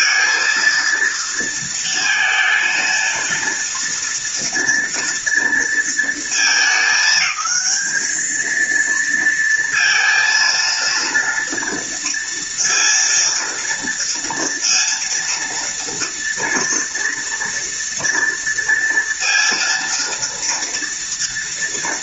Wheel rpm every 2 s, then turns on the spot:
230, 230, 230, 220, 220, 230, 230, 230, 230, 230, 230.
none